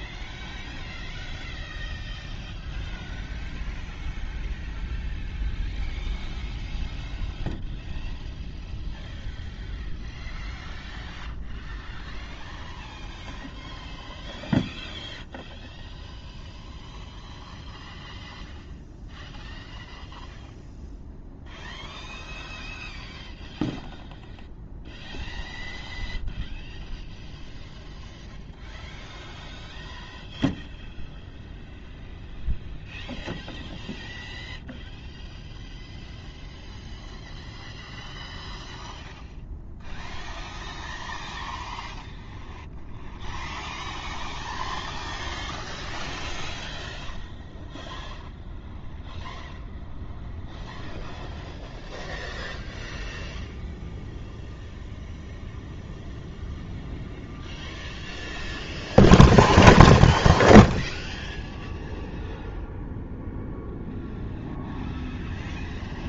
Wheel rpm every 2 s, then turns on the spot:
0, 0, 0, 0, 0, 0, 0, 0, 0, 0, 0, 0, 0, 0, 0, 0, 0, 0, 0, 0, 0, 0, 0, 0, 0, 0, 0, 0, 0, 0, 0, 0, 0.
none